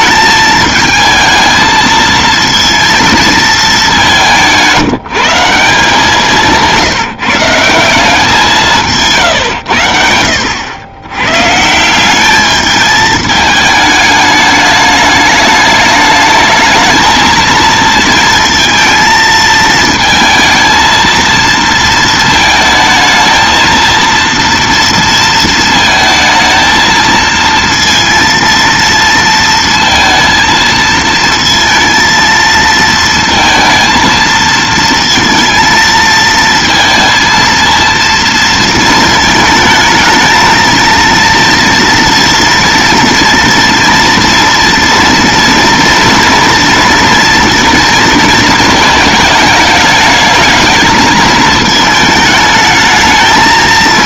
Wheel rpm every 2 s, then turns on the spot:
220, 230, 170, 160, 160, 90, 220, 210, 220, 230, 220, 220, 230, 220, 230, 230, 230, 230, 230, 220, 230, 230, 230, 230, 220, 220, 220.
none